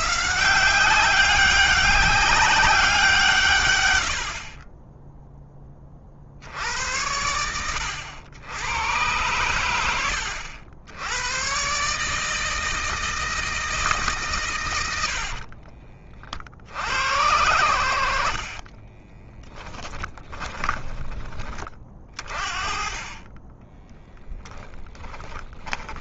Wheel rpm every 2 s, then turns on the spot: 190, 180, 20, 90, 100, 80, 160, 90, 80, 30, 20, 30, 10.
18-22 24-26